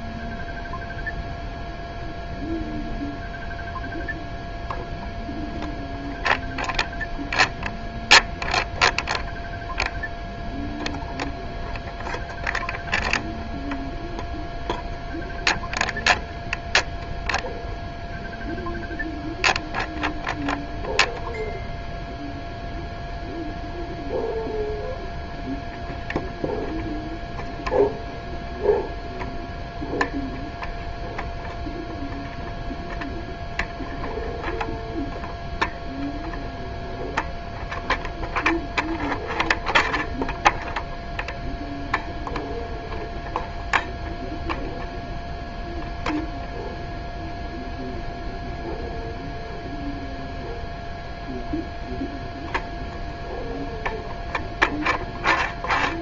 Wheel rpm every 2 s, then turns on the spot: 0, 0, 0, 0, 0, 0, 0, 0, 0, 0, 0, 0, 0, 0, 0, 0, 0, 0, 0, 0, 0, 0, 0, 0, 0, 0, 0, 0.
none